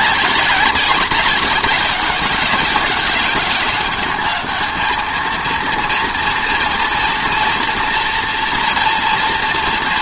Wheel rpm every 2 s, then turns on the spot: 200, 190, 220, 230, 230.
none